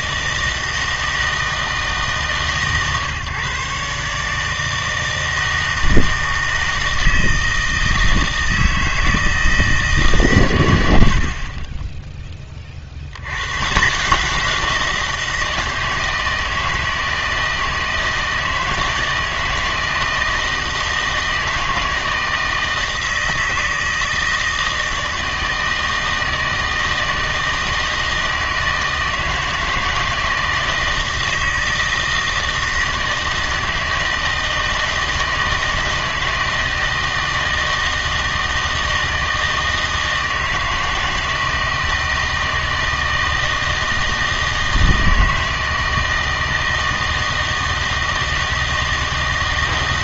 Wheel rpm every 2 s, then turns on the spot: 160, 140, 160, 160, 160, 110, 50, 170, 160, 160, 160, 160, 160, 160, 160, 160, 160, 160, 160, 160, 160, 160, 160, 160, 160.
none